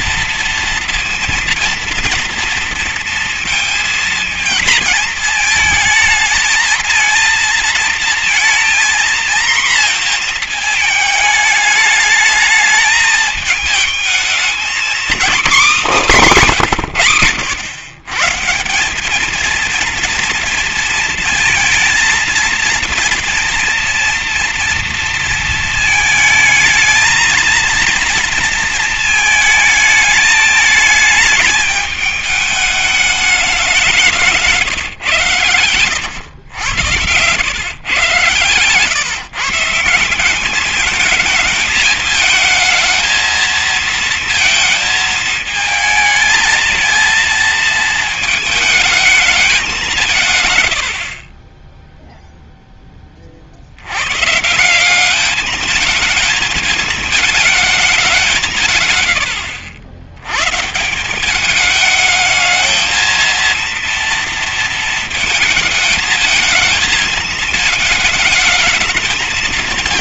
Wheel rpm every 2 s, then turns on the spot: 230, 230, 220, 220, 230, 220, 210, 240, 170, 170, 230, 230, 230, 220, 220, 220, 210, 140, 80, 120, 210, 220, 220, 230, 220, 100, 20, 190, 220, 150, 150, 220, 220, 220, 220.
none